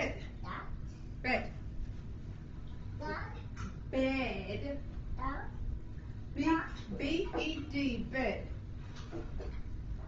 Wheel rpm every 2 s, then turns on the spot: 0, 0, 0, 0, 0.
none